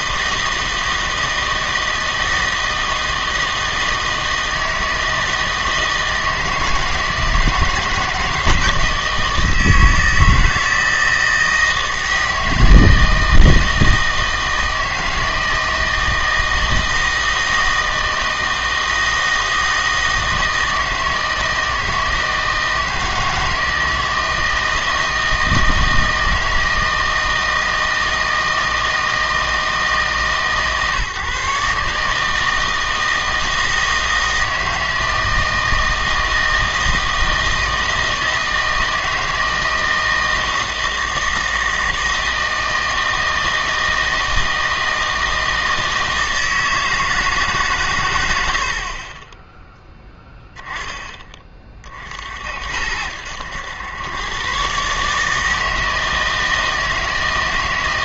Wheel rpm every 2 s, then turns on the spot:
160, 160, 160, 160, 160, 160, 160, 160, 160, 160, 160, 160, 160, 160, 160, 150, 160, 160, 160, 160, 160, 160, 160, 160, 60, 10, 70, 130, 160.
none